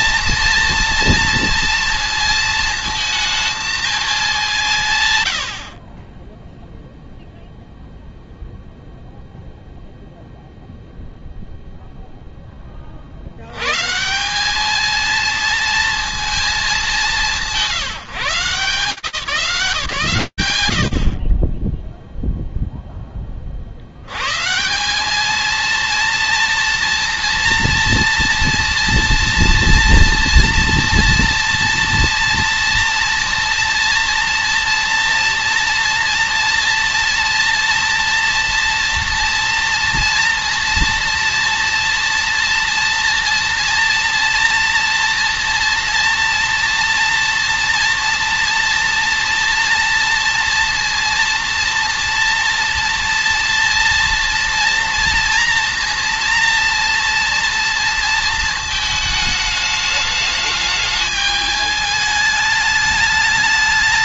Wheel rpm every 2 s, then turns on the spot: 230, 220, 60, 0, 0, 0, 90, 230, 180, 180, 40, 30, 210, 230, 240, 230, 230, 230, 230, 230, 230, 230, 230, 230, 230, 230, 230, 230, 230, 220, 210, 210.
none